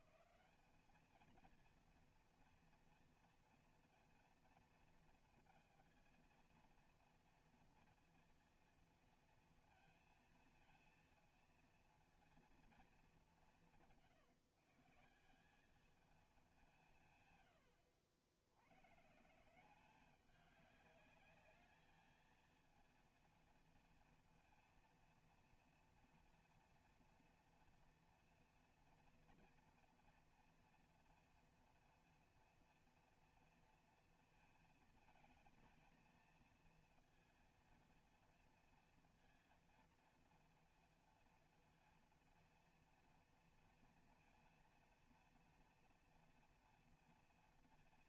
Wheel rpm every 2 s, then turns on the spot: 200, 230, 230, 230, 230, 230, 230, 150, 200, 90, 200, 230, 230, 240, 230, 230, 230, 230, 230, 230, 230, 230, 230, 230.
none